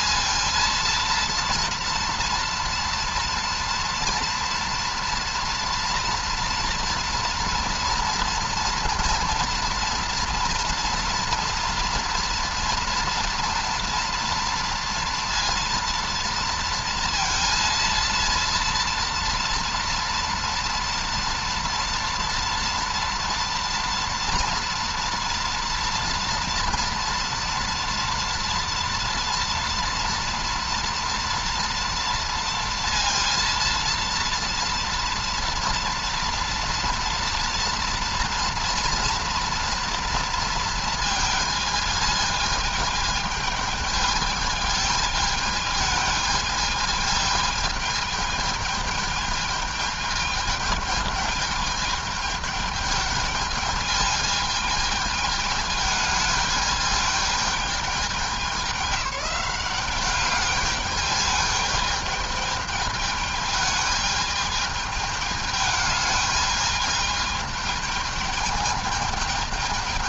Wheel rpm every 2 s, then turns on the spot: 230, 230, 230, 230, 240, 230, 230, 230, 230, 230, 230, 230, 230, 230, 230, 230, 230, 230, 230, 230, 230, 210, 210, 220, 210, 210, 210, 220, 210, 200, 210, 220, 210, 210, 210.
none